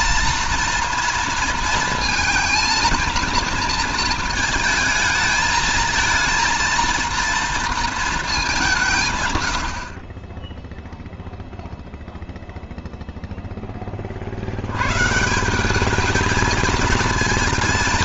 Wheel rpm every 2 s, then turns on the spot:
230, 230, 220, 230, 190, 10, 0, 100, 220.
none